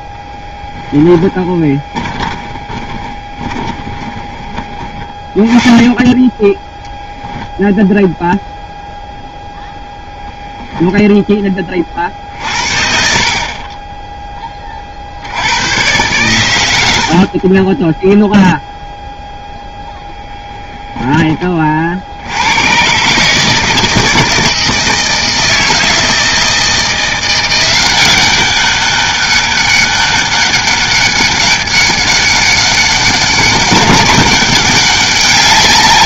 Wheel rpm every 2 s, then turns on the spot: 10, 20, 20, 0, 0, 0, 50, 30, 90, 0, 10, 110, 160, 160, 190, 200, 200, 200.
0-6 20-22